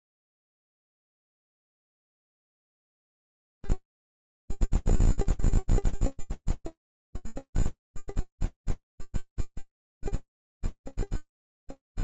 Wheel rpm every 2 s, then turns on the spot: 0, 0, 0, 0, 0, 0.
none